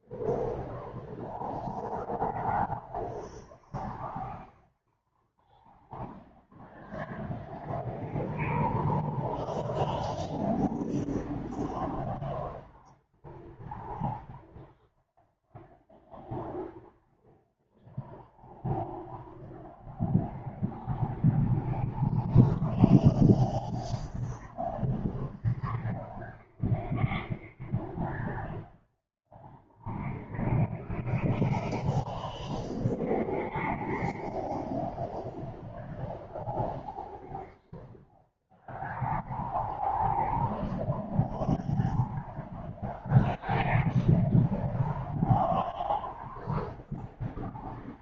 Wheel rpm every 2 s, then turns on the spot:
0, 0, 0, 0, 0, 0, 0, 0, 0, 0, 0, 0, 0, 0, 0, 0, 0, 0, 0, 0, 0, 0, 0, 0.
none